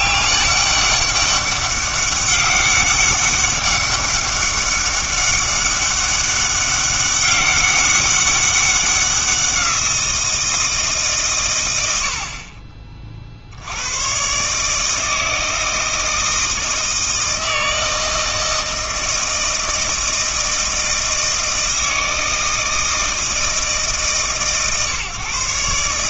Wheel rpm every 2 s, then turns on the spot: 200, 200, 200, 200, 190, 160, 30, 150, 160, 160, 160, 160, 140.
none